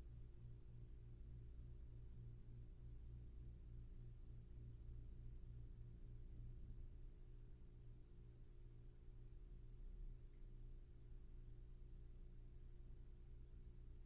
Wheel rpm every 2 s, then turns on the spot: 0, 0, 0, 0, 0, 0, 0.
none